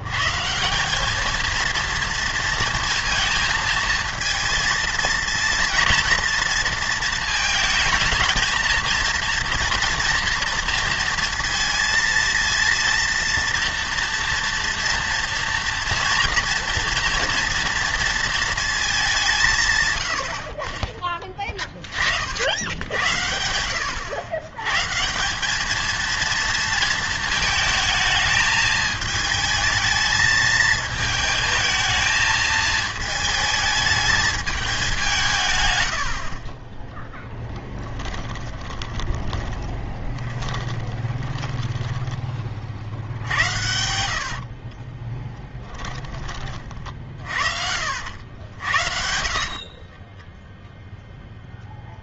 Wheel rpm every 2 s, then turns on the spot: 160, 230, 230, 230, 230, 230, 230, 230, 230, 220, 40, 80, 120, 230, 220, 220, 220, 200, 20, 30, 20, 50, 30, 40, 80, 0.
36-42 44-46 48-50